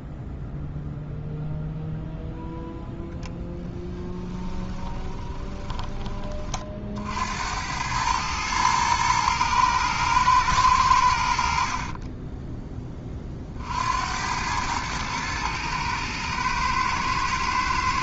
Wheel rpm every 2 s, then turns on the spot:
0, 0, 10, 40, 110, 100, 10, 110, 110.
4-6